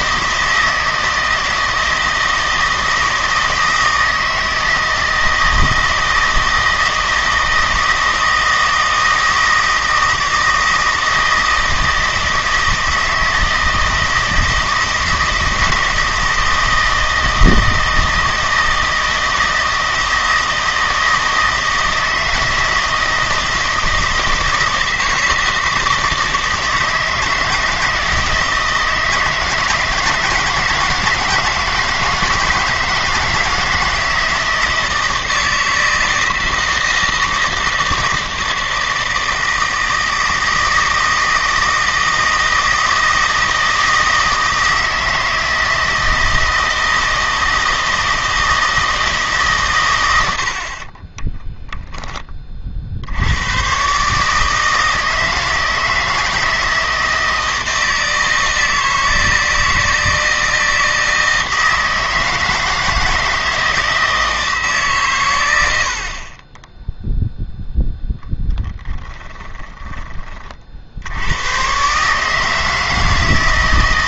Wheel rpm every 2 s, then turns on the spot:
160, 160, 160, 160, 160, 160, 160, 160, 160, 160, 160, 160, 160, 160, 160, 160, 160, 170, 160, 160, 160, 160, 160, 160, 160, 40, 50, 160, 160, 160, 160, 160, 150, 10, 10, 60, 160.
68-70